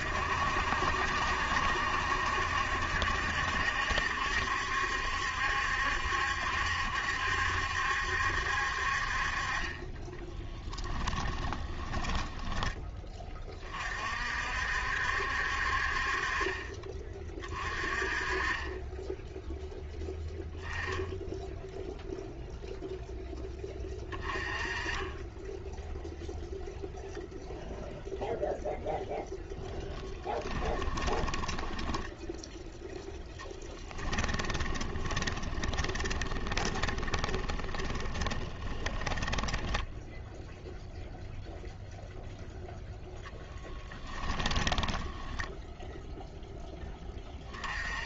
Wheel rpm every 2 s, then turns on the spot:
70, 70, 70, 70, 50, 10, 20, 70, 30, 20, 10, 0, 20, 0, 0, 20, 0, 20, 20, 20, 0, 0, 10, 20.
10-12 30-32 34-40 44-46